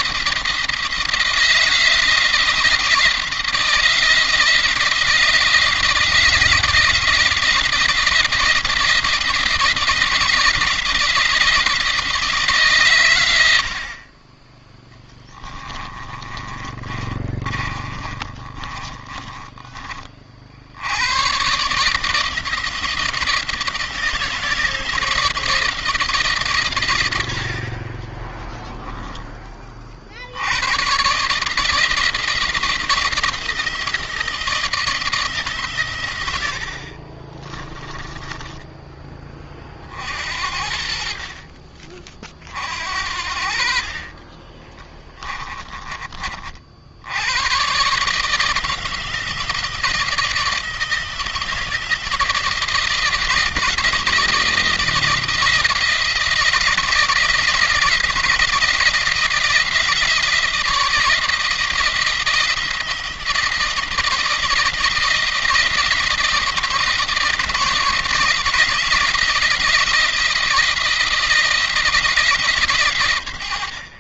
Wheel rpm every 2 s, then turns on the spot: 170, 170, 170, 170, 170, 170, 140, 10, 30, 30, 80, 170, 160, 120, 10, 110, 170, 170, 50, 10, 60, 50, 30, 60, 160, 170, 170, 170, 170, 170, 160, 170, 160, 160, 170, 160, 140.
14-20 28-30 36-38 44-46